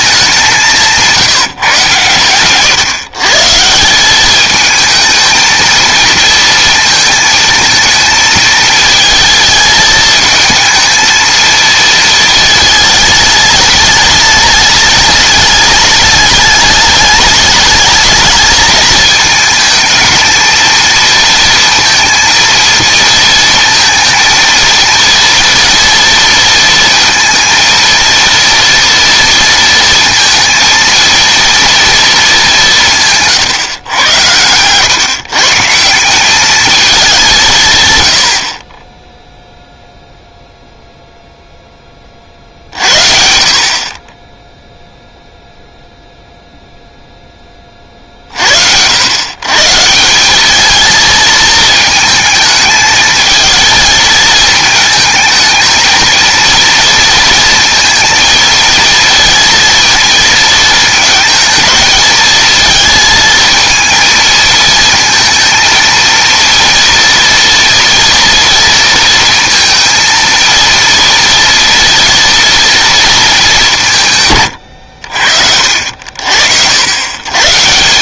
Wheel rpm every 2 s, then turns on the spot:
180, 130, 220, 220, 220, 220, 220, 210, 210, 220, 230, 230, 230, 230, 230, 230, 180, 120, 210, 30, 0, 50, 0, 0, 70, 220, 220, 220, 230, 230, 220, 220, 220, 230, 230, 230, 240, 110, 80.
none